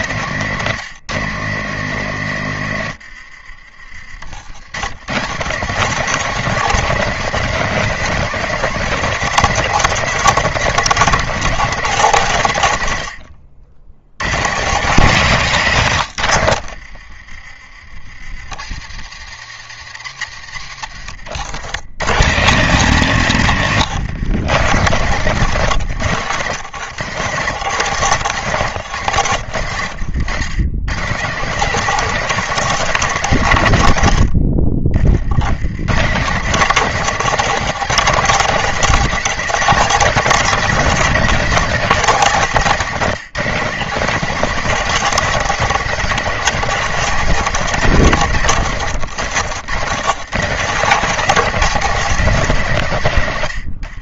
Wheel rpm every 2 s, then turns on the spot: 160, 120, 110, 200, 210, 210, 110, 160, 70, 90, 90, 150, 150, 140, 140, 150, 200, 40, 190, 210, 200, 180, 210, 200, 140, 200, 160.
2-4 16-18 20-22